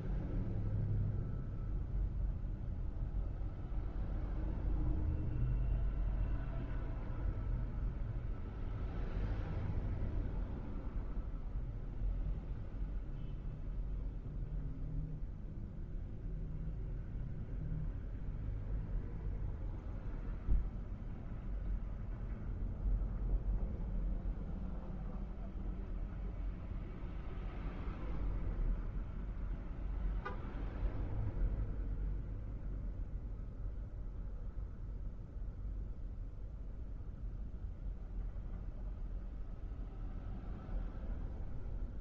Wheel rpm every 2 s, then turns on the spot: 0, 0, 0, 0, 0, 0, 0, 0, 0, 0, 0, 0, 0, 0, 0, 0, 0, 0, 0, 0, 0.
none